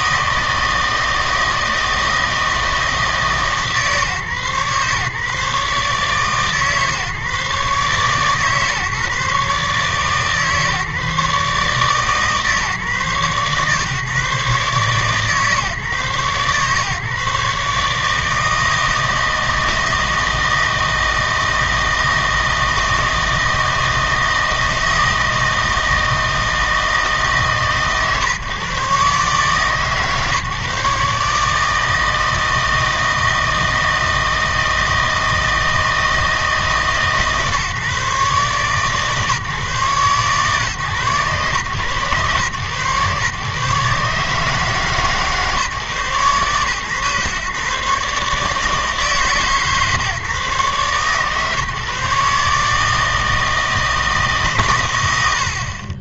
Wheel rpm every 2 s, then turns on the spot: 160, 160, 140, 140, 140, 140, 140, 140, 130, 160, 160, 160, 160, 160, 130, 140, 160, 160, 150, 140, 130, 110, 150, 130, 150, 140, 150, 130.
none